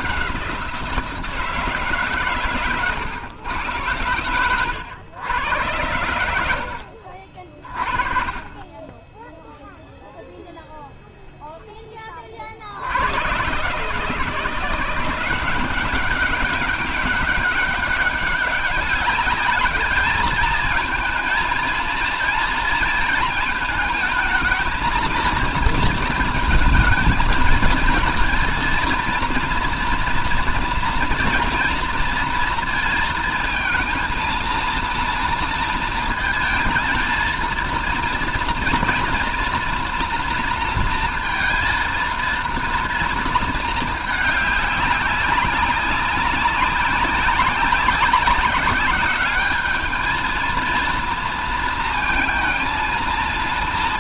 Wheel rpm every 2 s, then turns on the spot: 180, 130, 100, 80, 20, 0, 50, 170, 200, 190, 220, 230, 220, 220, 230, 230, 230, 230, 230, 230, 230, 230, 210, 190, 190, 220, 220.
none